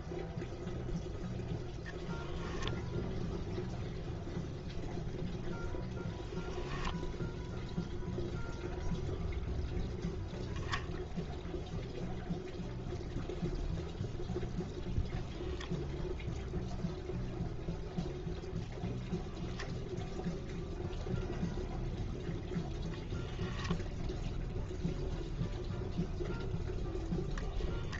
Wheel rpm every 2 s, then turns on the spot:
0, 0, 0, 0, 0, 0, 0, 0, 0, 0, 0, 0, 0, 0.
none